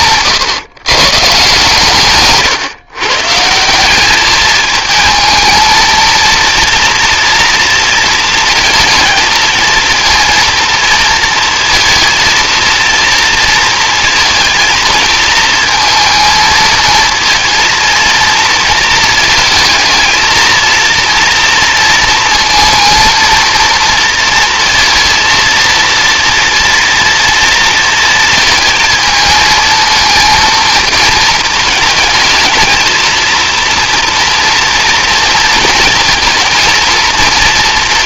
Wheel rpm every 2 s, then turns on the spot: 130, 140, 220, 240, 220, 230, 230, 230, 220, 230, 230, 230, 230, 230, 220, 230, 220, 230, 230.
none